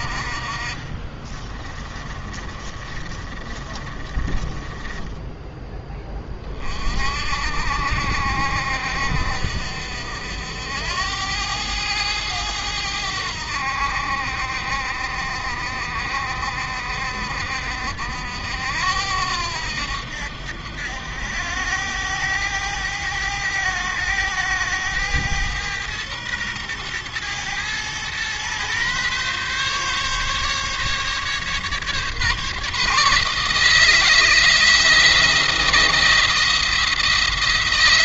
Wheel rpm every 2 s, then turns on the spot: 40, 30, 20, 40, 70, 80, 90, 60, 60, 80, 80, 100, 110, 110, 130, 140, 150, 170, 170.
0-6